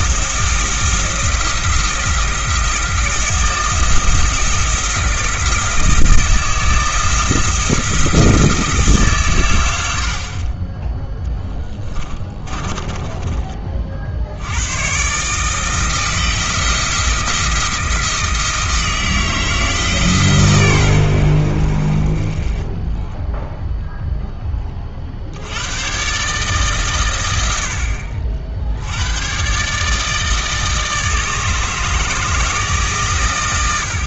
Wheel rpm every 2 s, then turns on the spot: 160, 170, 170, 160, 160, 20, 20, 100, 170, 160, 110, 20, 30, 130, 70, 160, 150.
12-14